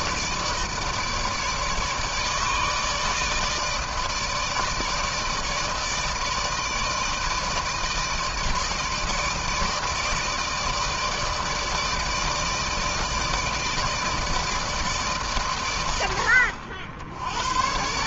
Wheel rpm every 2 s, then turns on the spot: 160, 160, 160, 160, 160, 160, 160, 160, 70.
none